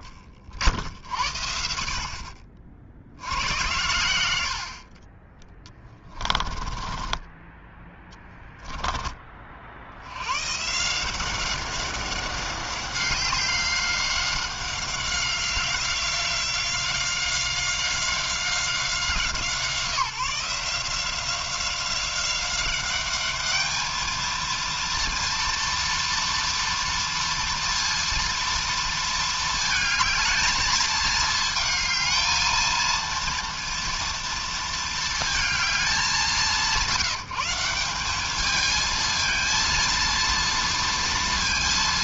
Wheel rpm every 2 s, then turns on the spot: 60, 50, 90, 20, 10, 130, 190, 190, 190, 180, 160, 190, 230, 230, 230, 220, 220, 230, 150, 210, 230.
6-8